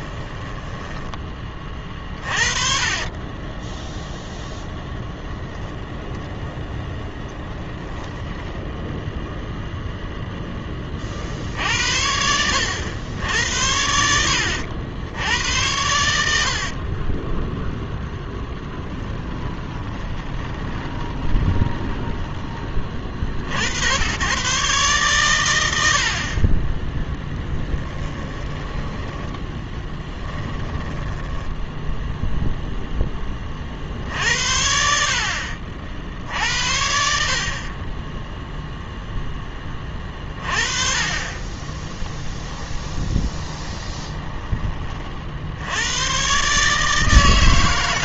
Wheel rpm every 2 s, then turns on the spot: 10, 40, 10, 0, 0, 40, 90, 80, 40, 10, 20, 40, 130, 10, 10, 10, 0, 60, 60, 0, 30, 10, 40, 150.
0-2 16-22 28-32 42-44